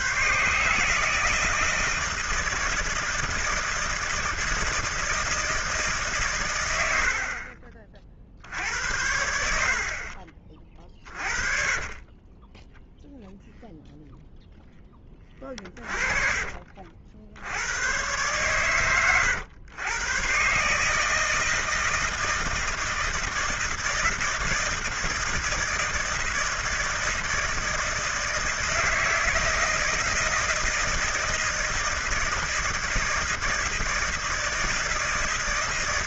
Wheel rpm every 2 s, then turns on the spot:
140, 160, 170, 90, 70, 30, 0, 10, 50, 120, 140, 160, 160, 160, 160, 160, 160, 160.
10-12